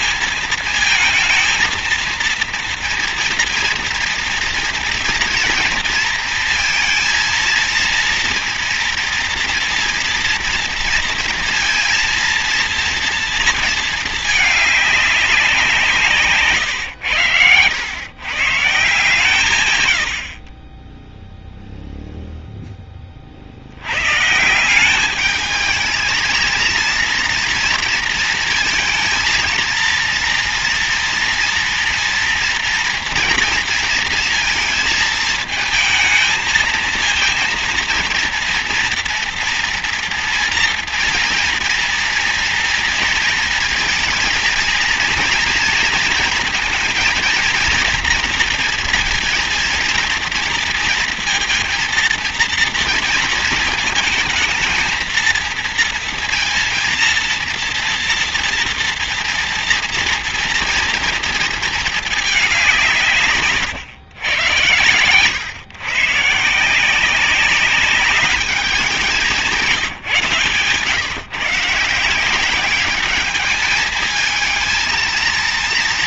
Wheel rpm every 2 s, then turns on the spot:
230, 230, 230, 230, 230, 230, 230, 210, 140, 140, 60, 0, 150, 220, 230, 230, 230, 230, 220, 230, 240, 230, 230, 230, 230, 230, 230, 220, 230, 230, 230, 210, 120, 140, 210, 160, 190, 220.
none